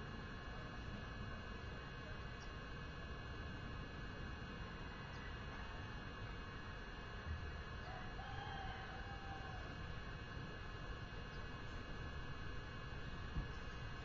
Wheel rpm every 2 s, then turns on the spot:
0, 0, 0, 0, 0, 0, 0.
none